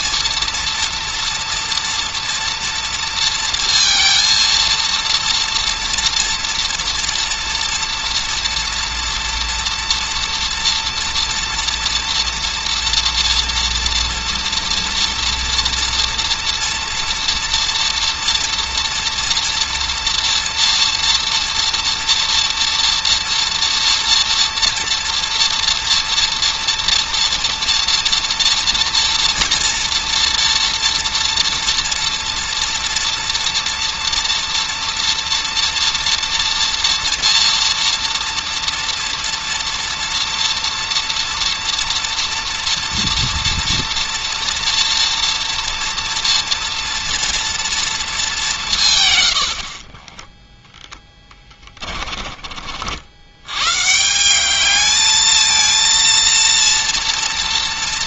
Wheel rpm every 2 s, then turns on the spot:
230, 230, 230, 230, 230, 230, 230, 230, 230, 230, 240, 230, 240, 230, 230, 230, 230, 230, 240, 240, 230, 230, 240, 230, 160, 10, 50, 210, 230.
none